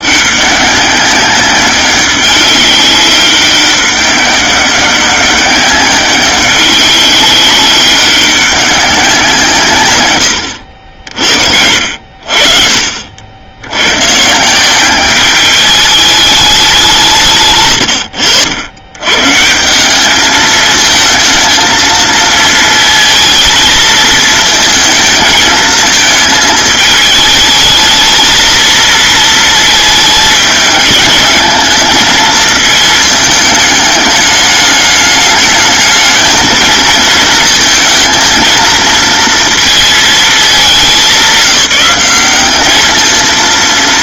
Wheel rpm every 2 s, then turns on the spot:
190, 190, 200, 200, 200, 70, 50, 190, 180, 100, 220, 220, 220, 220, 230, 210, 220, 210, 220, 230, 200, 220.
none